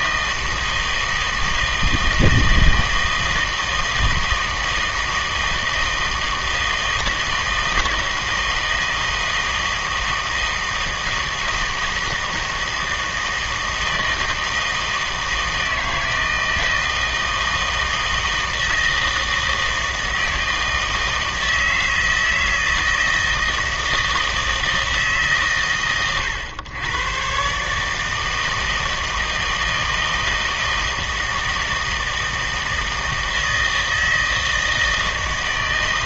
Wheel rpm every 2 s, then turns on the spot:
160, 160, 160, 160, 160, 160, 160, 160, 160, 160, 160, 160, 160, 110, 160, 160, 160, 160.
none